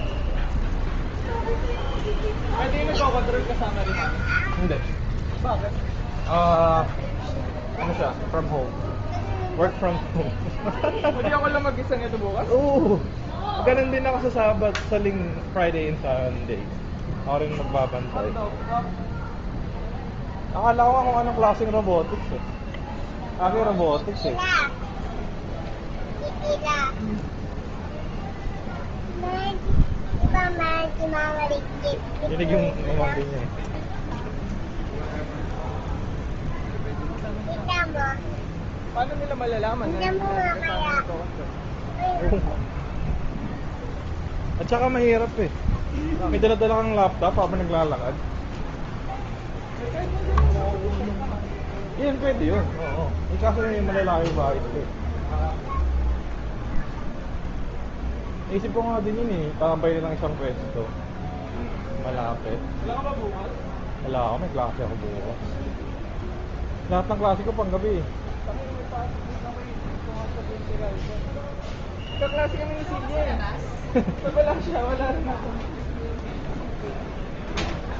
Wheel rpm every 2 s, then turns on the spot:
0, 0, 0, 0, 0, 0, 0, 0, 0, 0, 0, 0, 0, 0, 0, 0, 0, 0, 0, 0, 0, 0, 0, 0, 0, 0, 0, 0, 0, 0, 0, 0, 0, 0, 0, 0, 0, 0, 0.
none